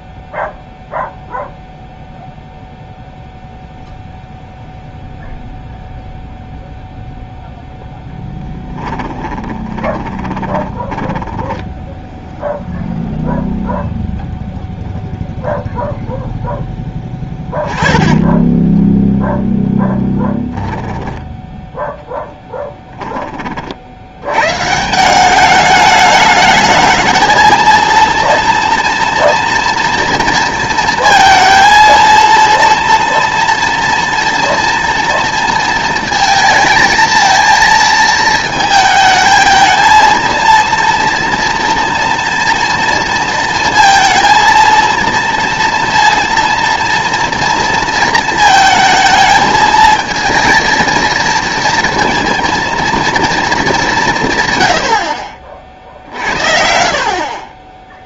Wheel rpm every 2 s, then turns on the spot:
0, 0, 0, 0, 10, 30, 0, 0, 10, 10, 10, 10, 130, 210, 230, 230, 230, 230, 230, 220, 230, 230, 230, 230, 230, 230, 230, 130, 70.
8-12 18-20 22-24